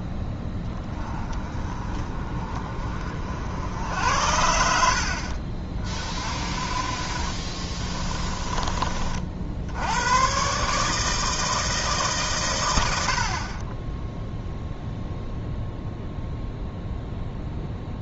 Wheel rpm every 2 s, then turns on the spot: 10, 30, 70, 40, 30, 140, 120, 0, 0.
none